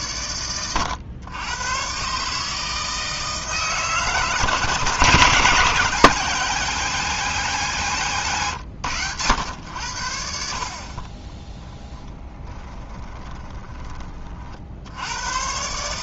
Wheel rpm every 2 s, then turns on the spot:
110, 160, 150, 180, 110, 40, 20, 70.
12-14